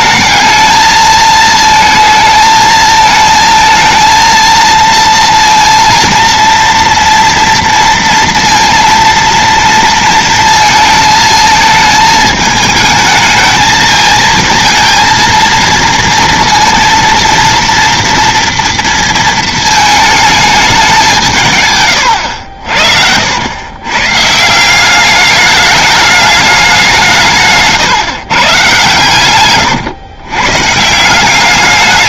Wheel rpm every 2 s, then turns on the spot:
220, 220, 230, 230, 230, 230, 220, 230, 230, 230, 210, 70, 180, 190, 130, 140.
none